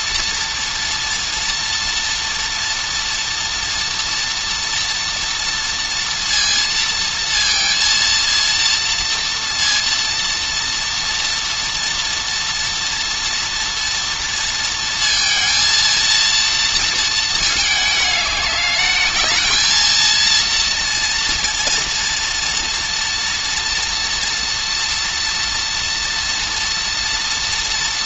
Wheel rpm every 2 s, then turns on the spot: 230, 230, 230, 230, 230, 230, 230, 230, 230, 210, 230, 230, 230, 240.
none